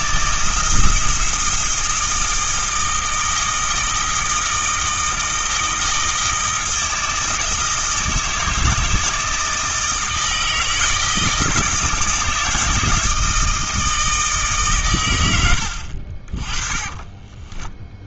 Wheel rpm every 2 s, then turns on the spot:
160, 160, 160, 160, 160, 160, 160, 120, 20.
16-18